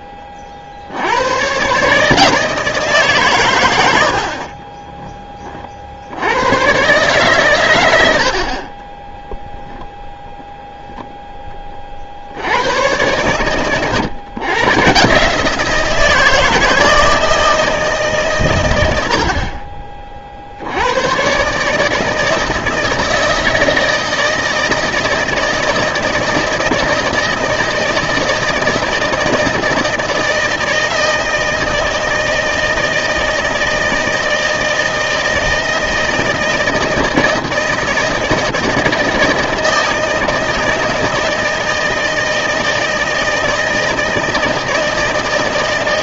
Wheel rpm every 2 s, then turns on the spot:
50, 160, 20, 120, 50, 0, 90, 130, 160, 110, 70, 160, 160, 160, 160, 160, 160, 160, 160, 160, 160, 160, 160.
4-6